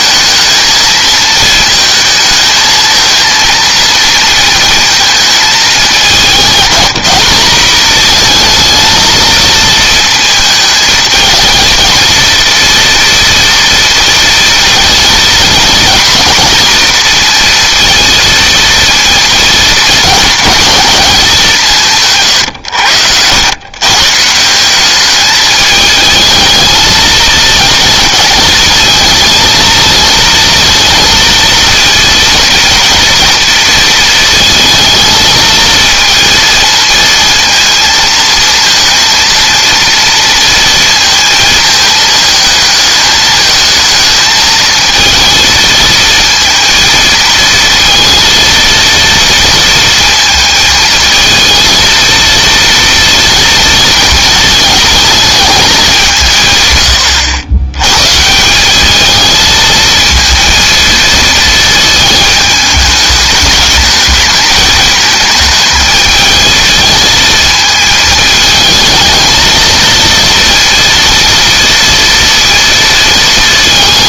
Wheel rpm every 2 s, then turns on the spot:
220, 220, 220, 200, 230, 220, 230, 230, 230, 230, 200, 90, 200, 220, 220, 230, 230, 220, 230, 230, 230, 220, 230, 220, 230, 220, 230, 220, 100, 210, 230, 210, 220, 220, 220, 230, 230.
none